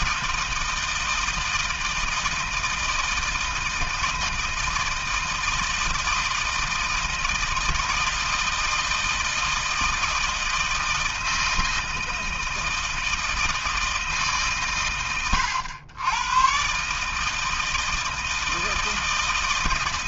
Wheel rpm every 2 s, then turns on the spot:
160, 160, 160, 160, 160, 160, 160, 100, 150, 160.
none